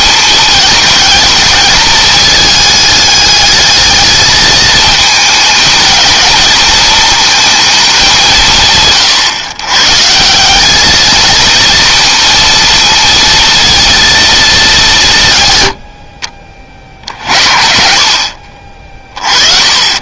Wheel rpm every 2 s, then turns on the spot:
220, 210, 220, 230, 150, 210, 230, 200, 50, 30.
none